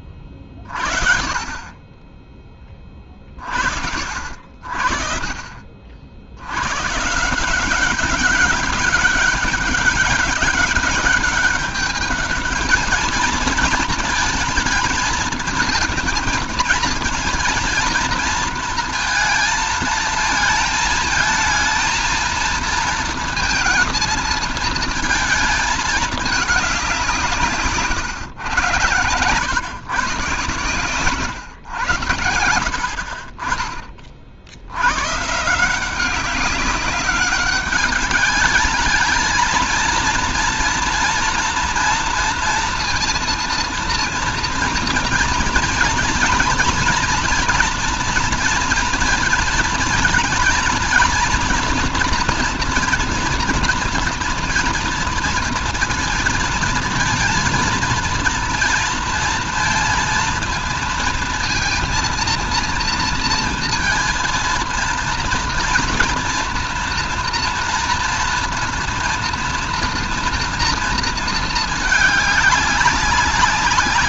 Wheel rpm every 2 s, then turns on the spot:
40, 20, 60, 90, 200, 200, 210, 220, 230, 230, 220, 220, 220, 210, 100, 120, 80, 80, 190, 210, 230, 230, 230, 230, 230, 230, 240, 240, 230, 230, 230, 230, 230, 240, 230, 230, 200.
32-34